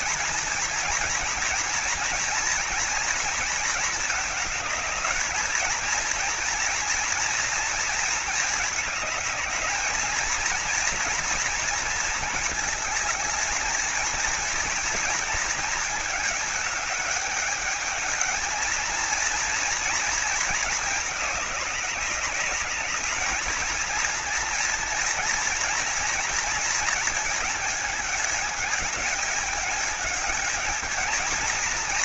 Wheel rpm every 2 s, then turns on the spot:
230, 230, 220, 230, 220, 230, 220, 230, 210, 230, 210, 210, 230, 220, 210, 220.
none